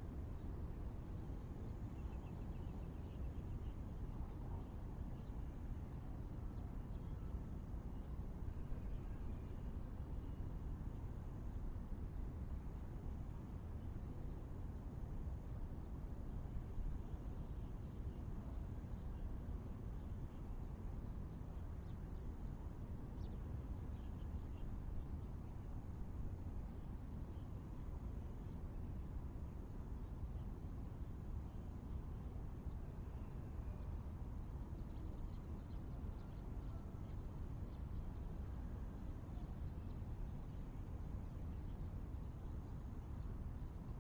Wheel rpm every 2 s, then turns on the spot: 0, 0, 0, 0, 0, 0, 0, 0, 0, 0, 0, 0, 0, 0, 0, 0, 0, 0, 0, 0, 0, 0.
none